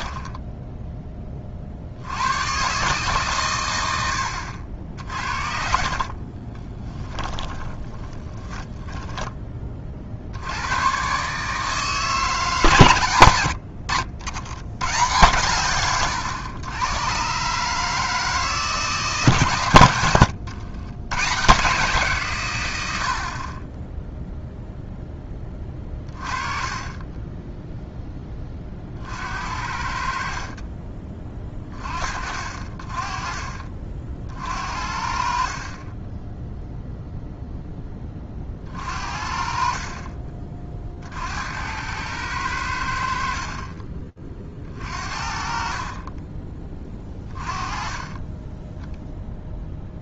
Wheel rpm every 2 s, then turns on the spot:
30, 120, 60, 20, 10, 140, 80, 110, 130, 160, 120, 70, 0, 20, 50, 20, 30, 50, 0, 50, 50, 80, 40, 20, 0.
4-8